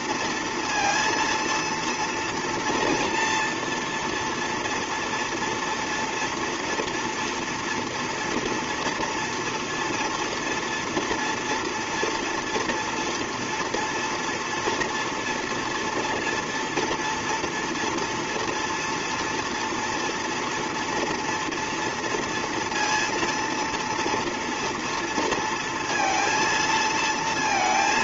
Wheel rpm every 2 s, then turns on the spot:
230, 230, 230, 230, 230, 230, 230, 240, 230, 240, 230, 230, 230, 230.
none